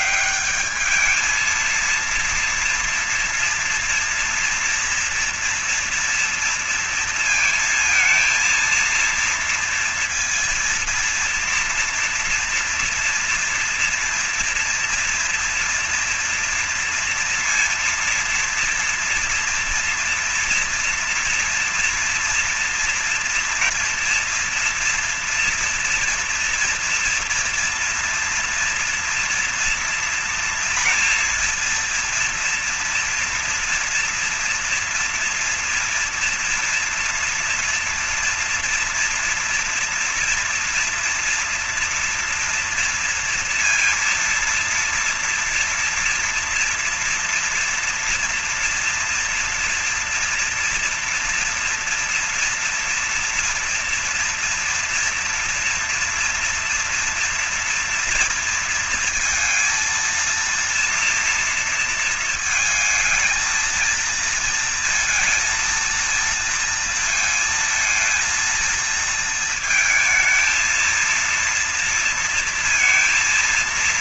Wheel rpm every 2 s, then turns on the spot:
210, 230, 230, 230, 230, 230, 230, 230, 230, 230, 230, 230, 230, 230, 230, 230, 240, 240, 230, 230, 240, 230, 230, 230, 240, 240, 230, 230, 230, 230, 230, 220, 230, 230, 230, 230, 230.
none